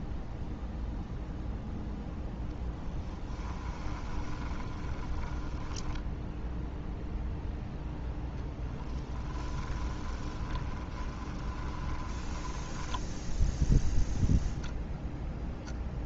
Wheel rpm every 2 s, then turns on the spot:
0, 0, 20, 0, 10, 30, 10, 0.
4-6 8-14